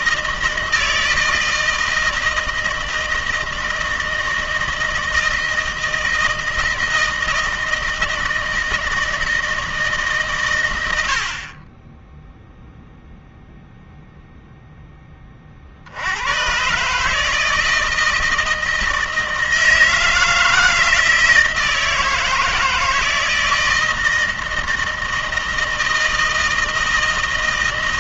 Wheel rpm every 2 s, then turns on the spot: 160, 160, 160, 160, 160, 100, 0, 10, 140, 160, 160, 160, 160, 160.
none